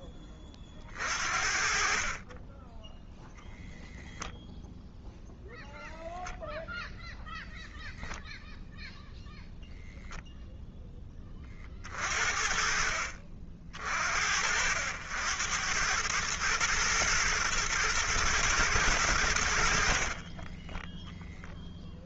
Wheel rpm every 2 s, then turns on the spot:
40, 10, 0, 0, 0, 0, 50, 70, 110, 110, 20.
20-22